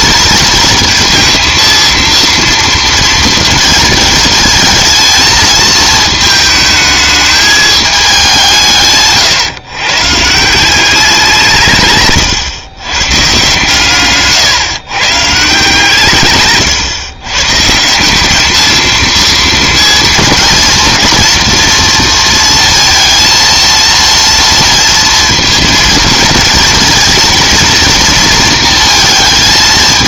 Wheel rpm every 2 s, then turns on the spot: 230, 230, 220, 220, 170, 180, 120, 130, 130, 220, 230, 230, 230, 230, 230.
none